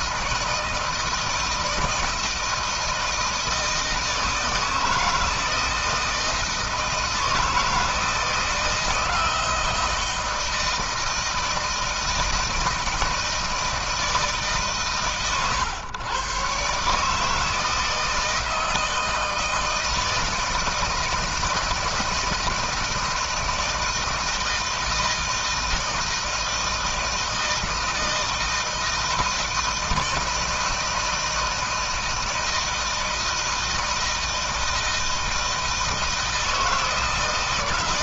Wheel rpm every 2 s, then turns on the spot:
160, 160, 160, 160, 160, 160, 160, 130, 140, 160, 160, 160, 160, 160, 160, 160, 160, 160, 160.
none